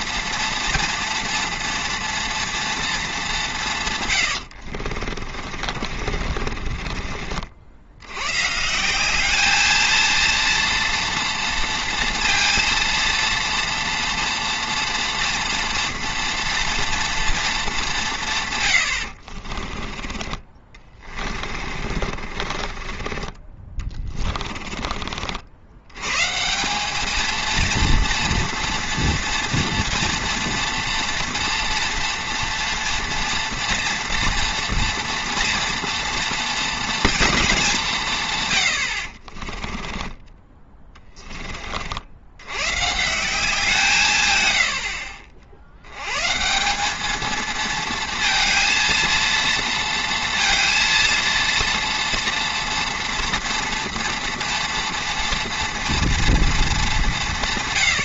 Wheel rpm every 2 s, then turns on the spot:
230, 230, 60, 40, 160, 230, 230, 230, 230, 100, 30, 30, 20, 190, 230, 230, 230, 230, 230, 100, 20, 130, 100, 180, 230, 230, 230, 230, 210.
4-8 20-24 40-42